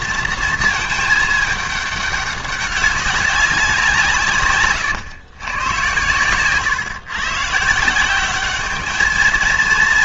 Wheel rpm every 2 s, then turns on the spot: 230, 200, 130, 120, 200.
4-6